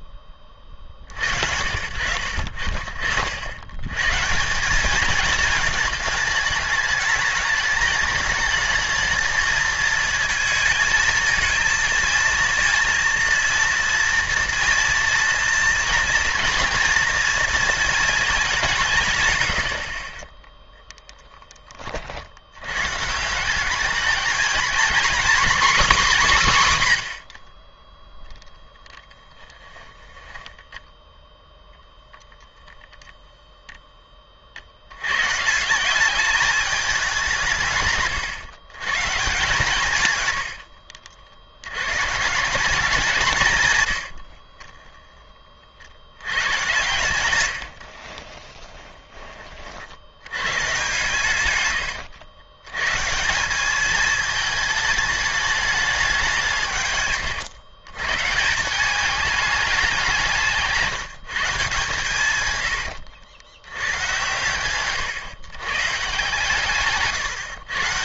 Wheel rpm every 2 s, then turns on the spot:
40, 60, 190, 210, 220, 220, 230, 230, 240, 190, 10, 110, 230, 160, 0, 10, 0, 60, 210, 130, 90, 200, 40, 100, 20, 130, 120, 220, 160, 180, 160, 120, 120, 150.
30-32 44-46 48-50 62-64 66-68